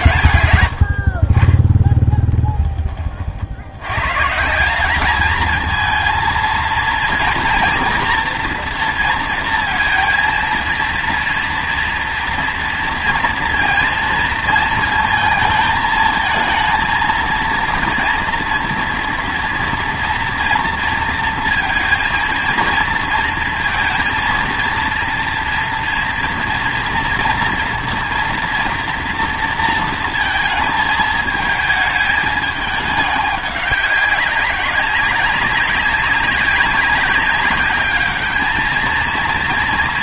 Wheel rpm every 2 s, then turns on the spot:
100, 10, 190, 230, 230, 230, 230, 230, 230, 230, 230, 230, 230, 230, 230, 220, 210, 200, 200, 220.
none